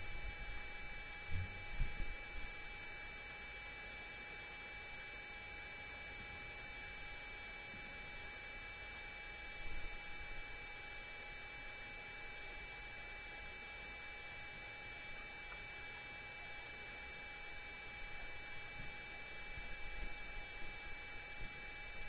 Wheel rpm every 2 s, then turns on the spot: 0, 0, 0, 0, 0, 0, 0, 0, 0, 0, 0.
none